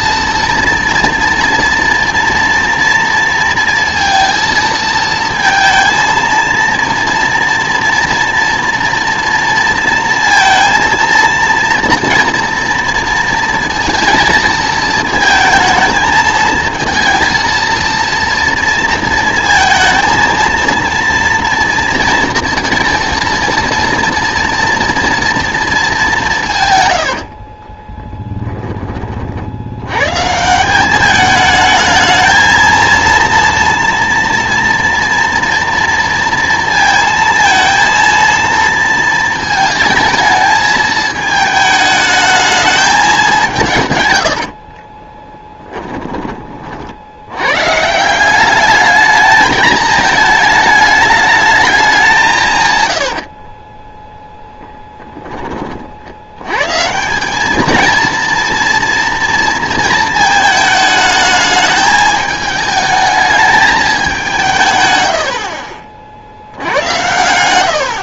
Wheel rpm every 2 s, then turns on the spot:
230, 230, 220, 230, 230, 230, 230, 220, 230, 230, 230, 230, 230, 120, 10, 170, 230, 230, 230, 230, 220, 220, 30, 40, 200, 210, 130, 10, 130, 230, 220, 210, 140, 90.
44-46 66-68